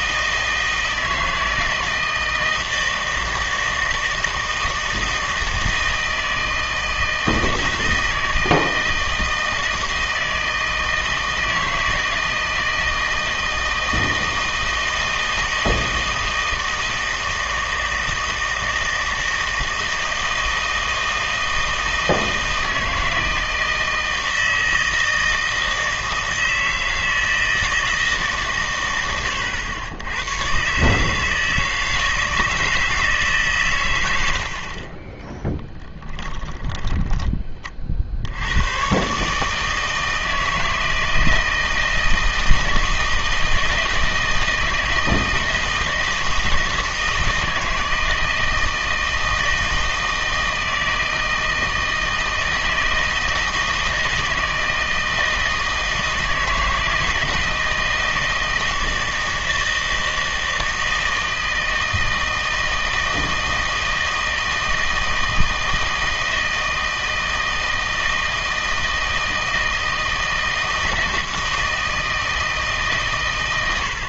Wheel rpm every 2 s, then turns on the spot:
160, 160, 160, 160, 160, 160, 160, 160, 160, 160, 160, 160, 160, 160, 120, 130, 160, 40, 10, 110, 160, 160, 160, 160, 160, 160, 160, 160, 160, 160, 160, 160, 160, 160, 160, 160, 160.
34-38